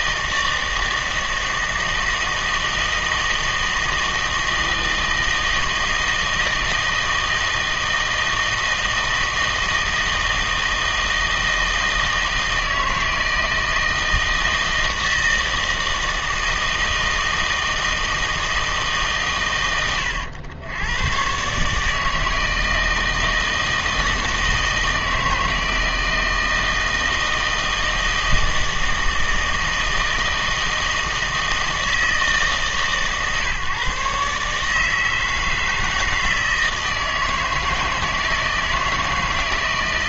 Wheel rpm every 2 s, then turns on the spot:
160, 160, 160, 160, 160, 160, 160, 160, 160, 160, 100, 160, 160, 160, 160, 160, 150, 150, 160, 160.
none